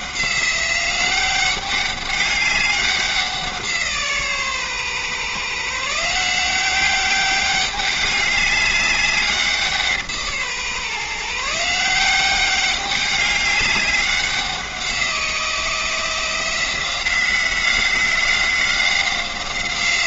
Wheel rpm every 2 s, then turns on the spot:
190, 200, 140, 190, 200, 150, 190, 180, 180, 180.
none